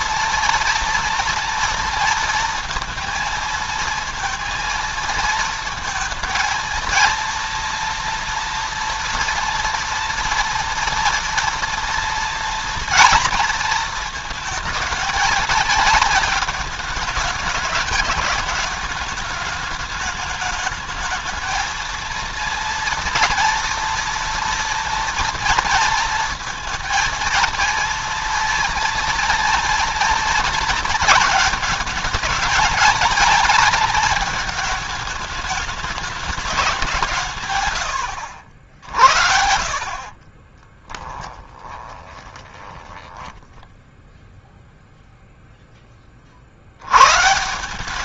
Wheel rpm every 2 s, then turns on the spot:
230, 230, 230, 230, 230, 230, 240, 220, 220, 220, 210, 230, 230, 230, 230, 230, 230, 220, 200, 90, 30, 20, 0, 70.
40-42